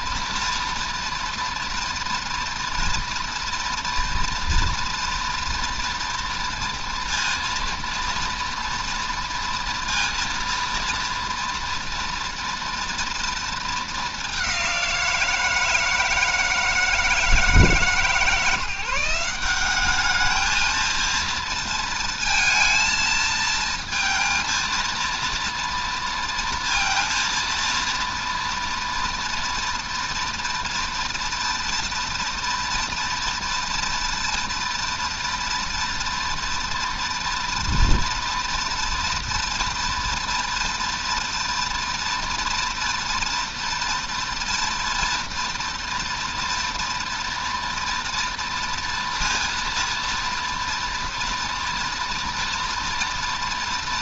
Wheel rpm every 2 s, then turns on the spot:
240, 230, 240, 240, 230, 230, 230, 180, 160, 170, 220, 220, 230, 230, 230, 230, 230, 240, 240, 230, 230, 230, 240, 240, 230, 230, 230.
none